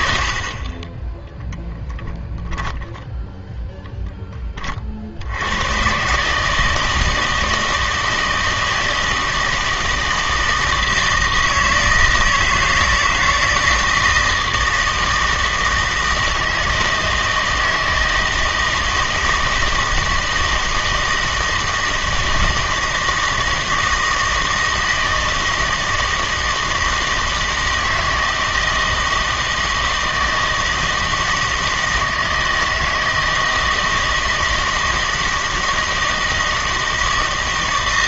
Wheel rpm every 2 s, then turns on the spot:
40, 10, 40, 160, 160, 160, 160, 160, 160, 160, 160, 160, 160, 160, 160, 160, 160, 160, 160.
2-4